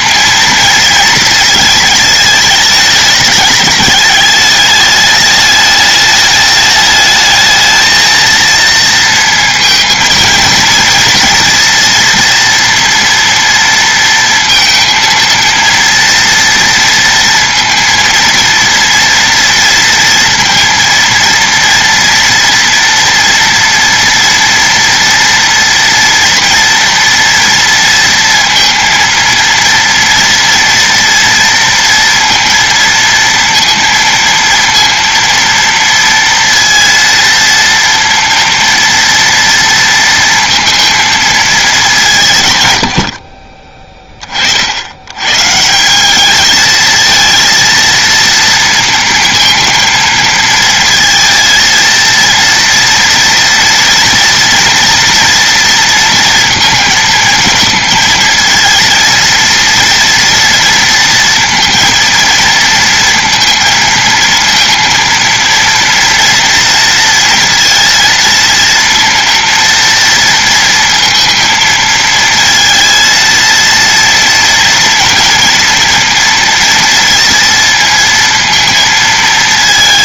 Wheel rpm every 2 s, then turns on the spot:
230, 220, 210, 210, 230, 230, 230, 230, 230, 230, 230, 230, 230, 230, 230, 230, 230, 230, 230, 230, 230, 100, 80, 220, 230, 220, 230, 230, 230, 230, 230, 230, 230, 230, 230, 230, 230, 230, 230, 220.
none